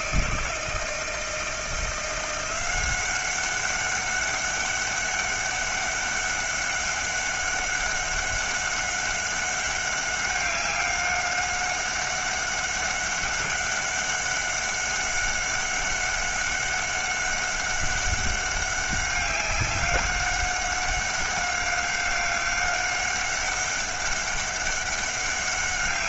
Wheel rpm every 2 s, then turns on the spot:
160, 180, 200, 200, 190, 190, 200, 190, 200, 200, 200, 190, 190.
none